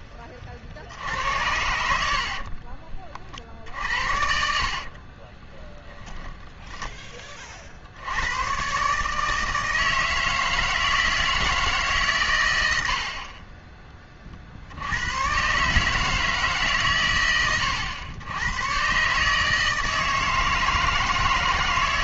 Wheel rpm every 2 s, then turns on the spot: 50, 40, 60, 10, 130, 160, 100, 60, 140, 120, 160.
2-8